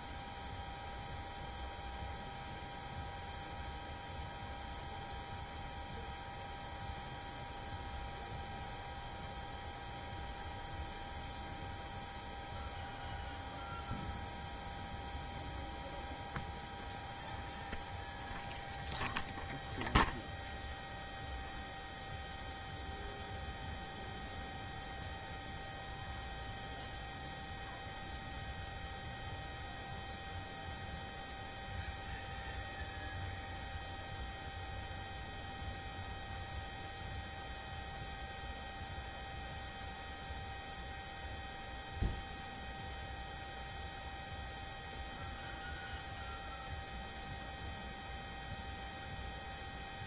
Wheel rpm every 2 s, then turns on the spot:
0, 0, 0, 0, 0, 0, 0, 0, 0, 0, 0, 0, 0, 0, 0, 0, 0, 0, 0, 0, 0, 0, 0, 0, 0.
none